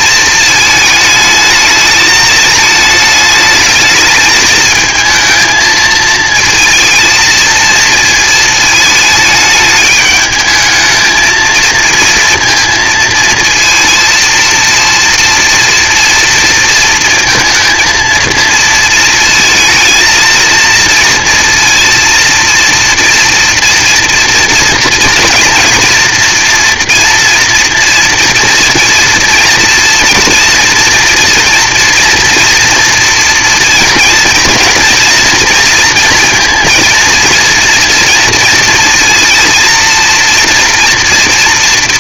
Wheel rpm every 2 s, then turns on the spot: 220, 220, 220, 220, 220, 220, 230, 230, 230, 230, 230, 230, 230, 230, 240, 230, 230, 230, 230, 230, 230.
none